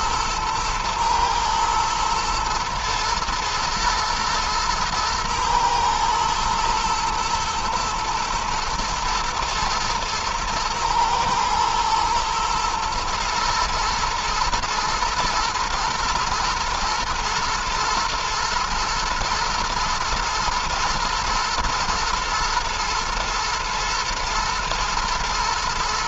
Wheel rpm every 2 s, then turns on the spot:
120, 120, 110, 120, 110, 110, 110, 120, 120, 110, 110, 110, 110.
none